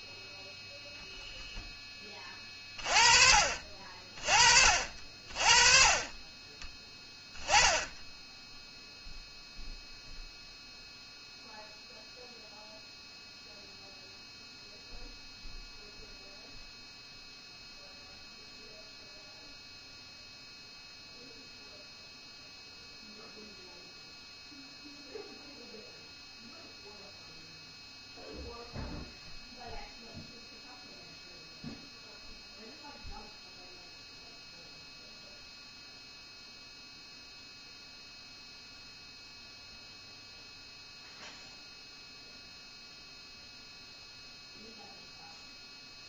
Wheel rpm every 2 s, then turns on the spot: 0, 30, 40, 20, 0, 0, 0, 0, 0, 0, 0, 0, 0, 0, 0, 0, 0, 0, 0, 0, 0, 0, 0.
none